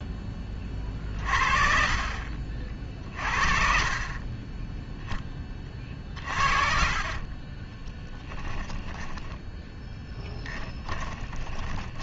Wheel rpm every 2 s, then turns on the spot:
20, 40, 10, 40, 10, 10.
4-6 8-12